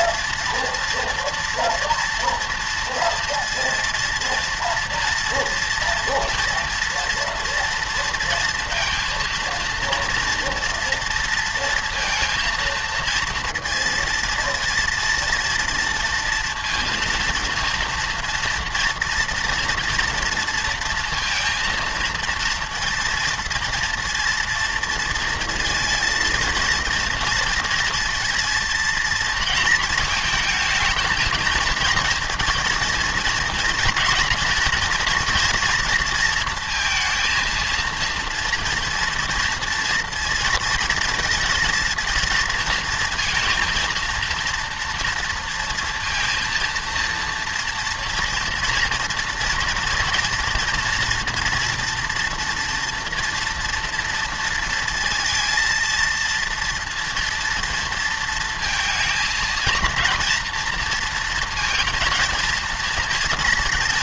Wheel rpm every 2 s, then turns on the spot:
230, 230, 230, 230, 230, 230, 230, 230, 230, 230, 230, 230, 230, 230, 230, 220, 230, 240, 230, 230, 230, 230, 230, 230, 240, 230, 230, 230, 230, 230, 230, 230.
none